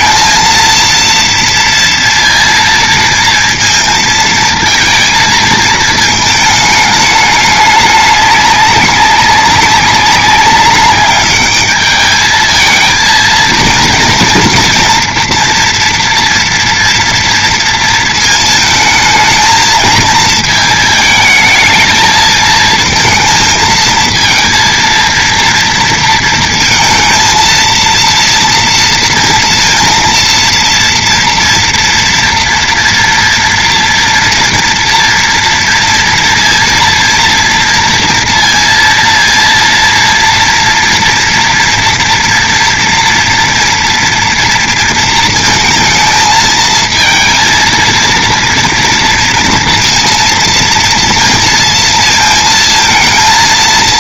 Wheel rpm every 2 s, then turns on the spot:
230, 230, 230, 220, 200, 200, 220, 230, 230, 220, 220, 220, 230, 230, 230, 230, 240, 230, 230, 230, 230, 230, 230, 220, 230, 230, 230.
none